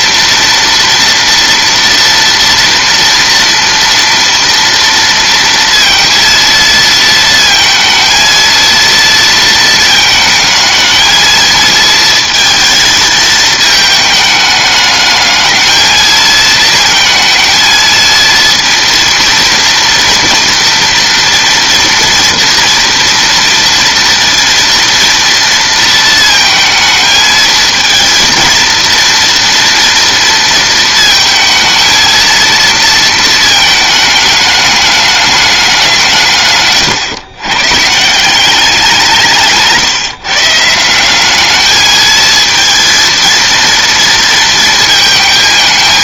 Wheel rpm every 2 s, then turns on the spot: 230, 230, 230, 230, 230, 220, 220, 210, 230, 230, 230, 230, 230, 220, 230, 230, 220, 210, 110, 180, 170, 230, 220.
none